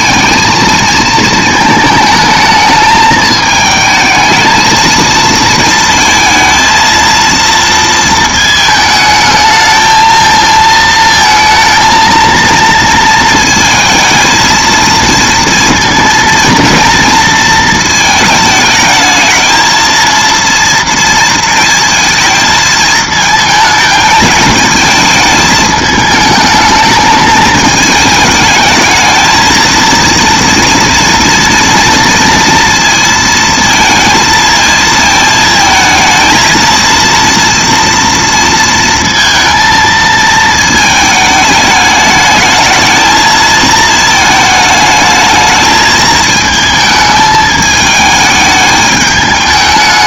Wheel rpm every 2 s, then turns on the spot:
220, 220, 230, 230, 220, 220, 230, 230, 230, 220, 230, 220, 220, 210, 220, 230, 230, 220, 230, 230, 220, 220, 220, 220, 210.
none